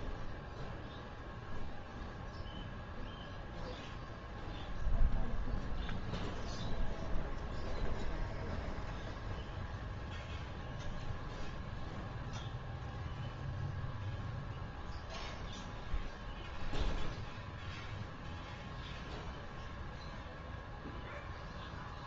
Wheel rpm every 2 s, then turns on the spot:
0, 0, 0, 0, 0, 0, 0, 0, 0, 0, 0.
none